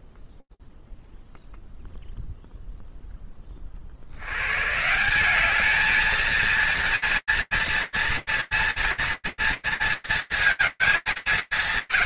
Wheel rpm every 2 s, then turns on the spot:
0, 0, 130, 230, 240, 230.
none